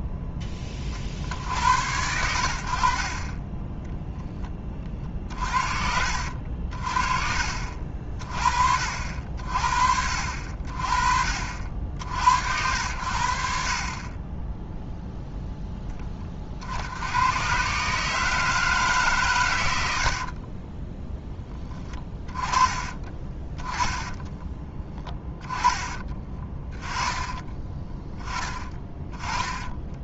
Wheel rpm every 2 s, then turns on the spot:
40, 60, 20, 50, 40, 50, 90, 10, 90, 150, 10, 20, 20, 20, 20.
22-24